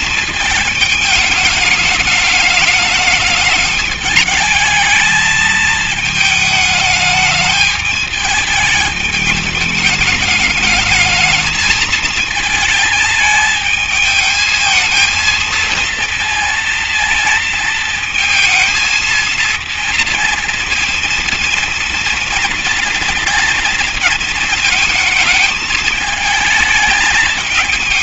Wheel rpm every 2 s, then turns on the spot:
220, 210, 220, 220, 220, 220, 220, 220, 230, 230, 230, 230, 220, 210.
none